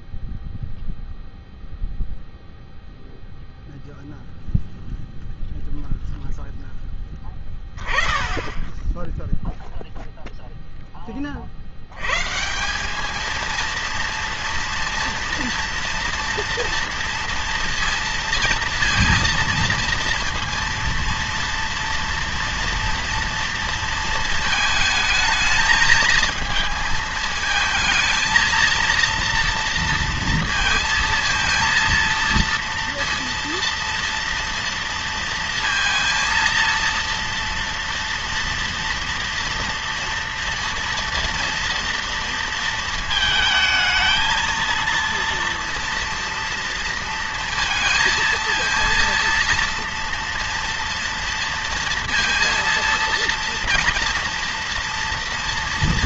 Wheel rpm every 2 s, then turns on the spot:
0, 0, 0, 10, 10, 10, 180, 230, 230, 230, 230, 230, 220, 220, 230, 230, 230, 230, 230, 230, 230, 230, 230, 230, 230, 230, 230, 230.
none